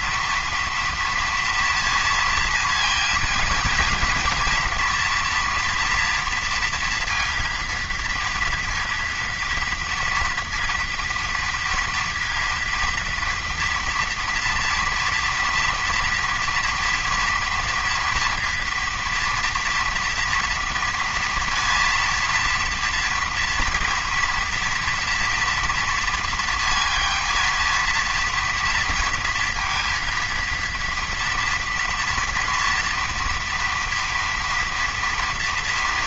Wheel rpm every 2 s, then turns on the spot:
230, 230, 230, 230, 230, 230, 230, 230, 230, 240, 230, 230, 230, 230, 230, 230, 230, 230.
none